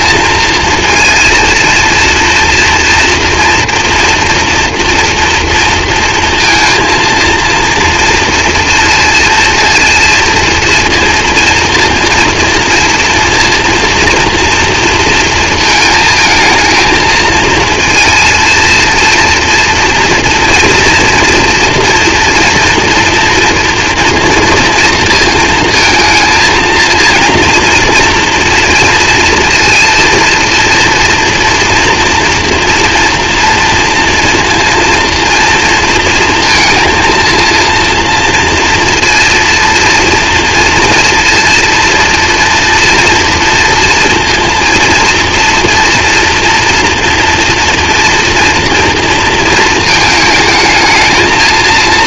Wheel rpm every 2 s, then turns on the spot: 230, 230, 240, 230, 230, 230, 230, 230, 230, 230, 230, 240, 230, 230, 230, 230, 240, 240, 230, 230, 230, 230, 230, 230, 230, 220.
none